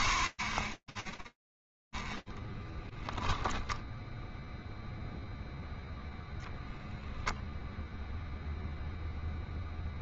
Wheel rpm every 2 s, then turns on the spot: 10, 10, 0, 0, 0.
none